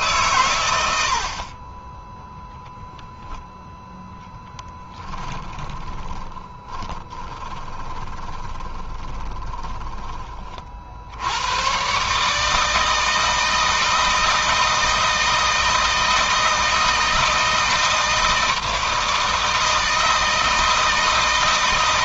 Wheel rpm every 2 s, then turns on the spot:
120, 0, 10, 20, 20, 40, 150, 160, 160, 160, 160.
4-10